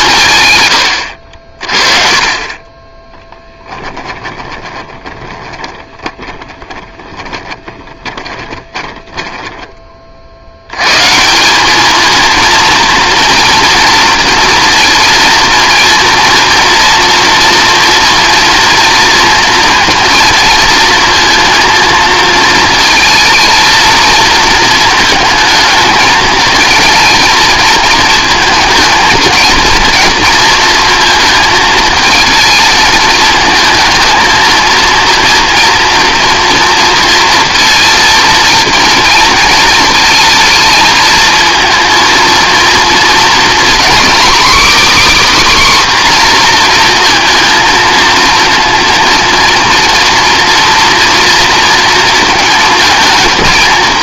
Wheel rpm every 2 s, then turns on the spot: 80, 20, 20, 10, 20, 90, 230, 230, 230, 230, 220, 220, 220, 230, 230, 230, 220, 230, 230, 230, 220, 230, 290, 240, 230, 240, 220.
4-10